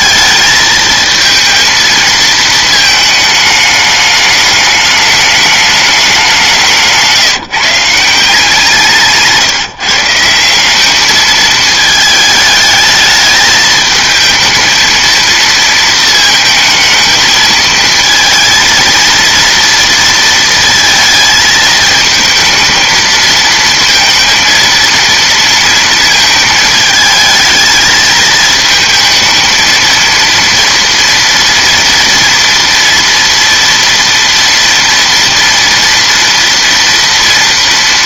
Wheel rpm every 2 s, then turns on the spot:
220, 220, 210, 170, 160, 210, 210, 220, 220, 230, 230, 230, 230, 220, 220, 240, 230, 230, 230.
8-10